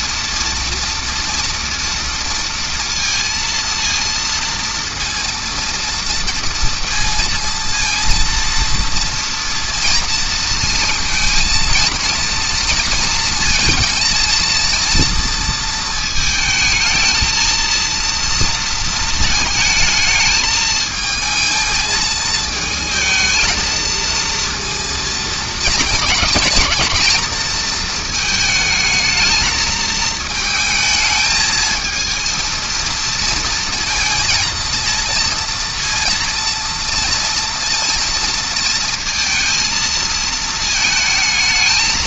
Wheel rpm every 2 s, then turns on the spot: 230, 230, 230, 230, 230, 230, 230, 230, 220, 230, 220, 220, 230, 230, 220, 220, 230, 230, 230, 230, 220.
none